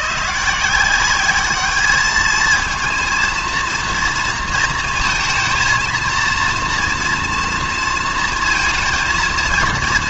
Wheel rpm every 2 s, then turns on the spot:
180, 230, 230, 230, 230.
none